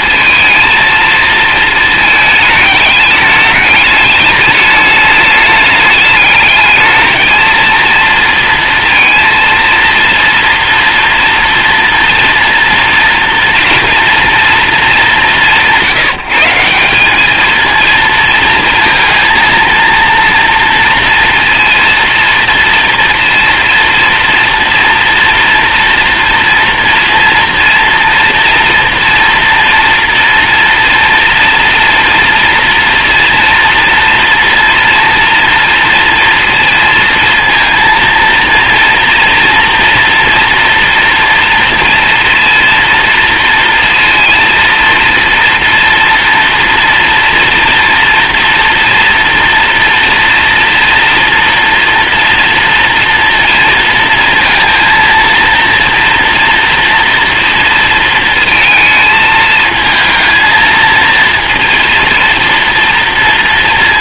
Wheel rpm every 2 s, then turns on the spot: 220, 210, 210, 220, 230, 230, 230, 210, 190, 230, 230, 230, 230, 230, 230, 230, 230, 230, 230, 230, 230, 230, 230, 230, 230, 230, 230, 230, 240, 230, 230, 230.
none